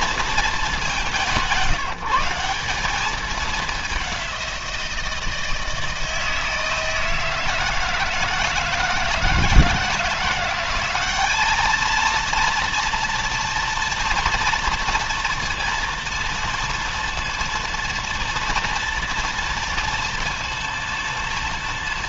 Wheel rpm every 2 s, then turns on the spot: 200, 200, 170, 160, 170, 200, 230, 230, 230, 230, 230.
none